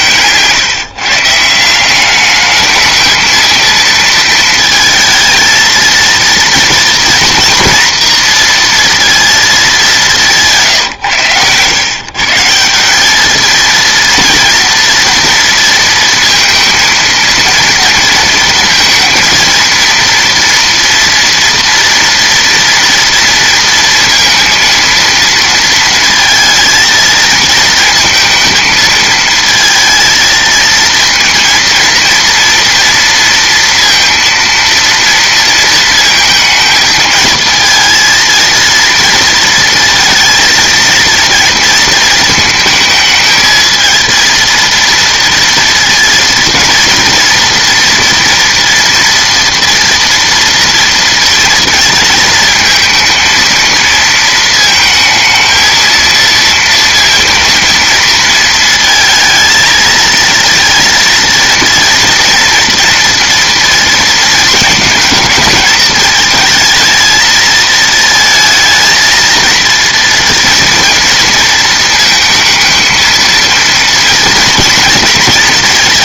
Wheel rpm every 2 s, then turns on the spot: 140, 210, 220, 230, 230, 150, 180, 230, 230, 230, 230, 230, 230, 220, 220, 230, 230, 230, 220, 230, 230, 220, 230, 230, 230, 230, 230, 220, 230, 230, 230, 230, 230, 220, 220, 230, 230, 230.
none